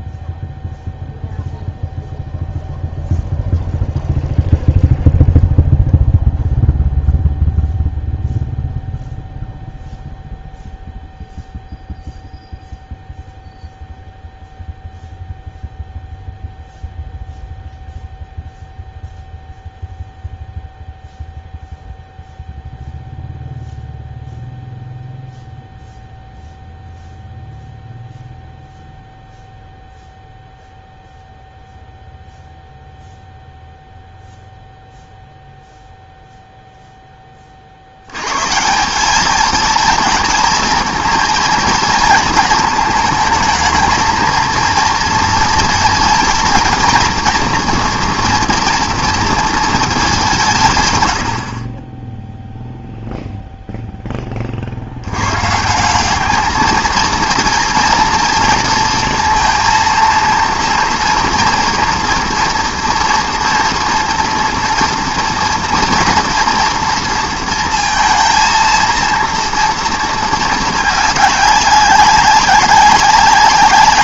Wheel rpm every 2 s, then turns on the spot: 0, 0, 0, 0, 0, 0, 0, 0, 0, 0, 0, 0, 0, 0, 0, 0, 0, 0, 0, 160, 230, 220, 230, 230, 230, 140, 0, 60, 220, 230, 230, 230, 230, 230, 230, 210, 190.
none